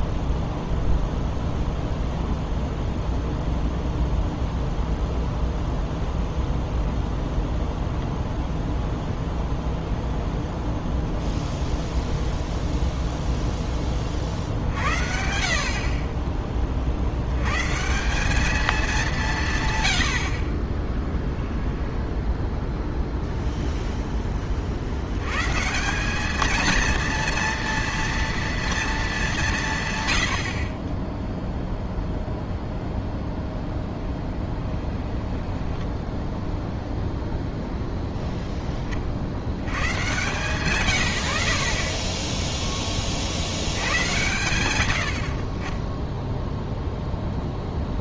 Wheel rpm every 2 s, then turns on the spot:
0, 0, 0, 0, 0, 0, 0, 60, 40, 210, 30, 0, 50, 230, 230, 40, 0, 20, 0, 10, 120, 10, 110, 0.
34-36